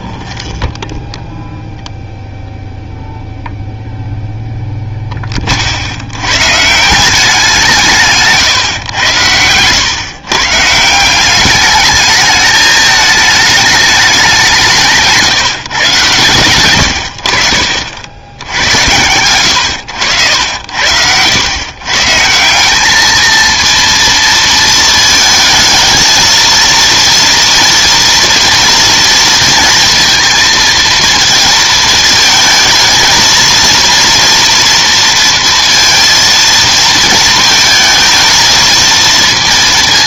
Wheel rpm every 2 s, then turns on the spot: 10, 0, 0, 160, 120, 160, 210, 170, 100, 90, 90, 200, 230, 230, 230, 230, 220, 230, 230, 230.
0-2 16-18